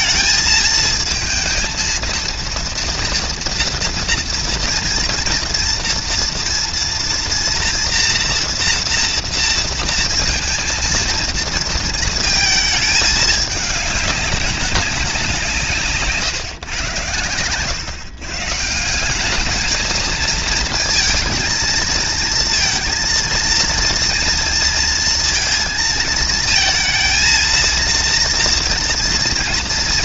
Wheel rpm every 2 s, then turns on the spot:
220, 230, 230, 230, 230, 230, 210, 190, 120, 180, 230, 230, 230, 230, 230.
none